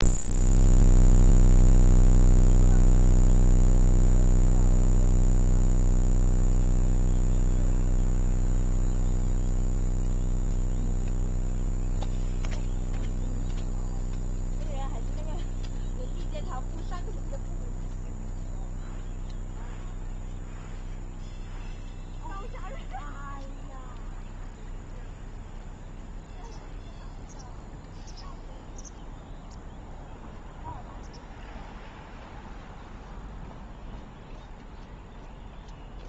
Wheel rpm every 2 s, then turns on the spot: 0, 0, 0, 0, 0, 0, 0, 0, 0, 0, 0, 0, 0, 0, 0, 0, 0, 0.
none